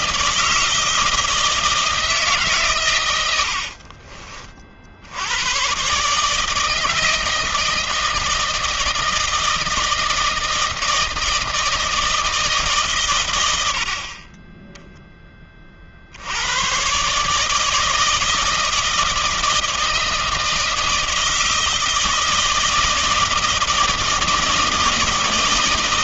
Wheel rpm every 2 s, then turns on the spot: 160, 150, 50, 150, 160, 160, 160, 30, 90, 160, 160, 160, 160.
none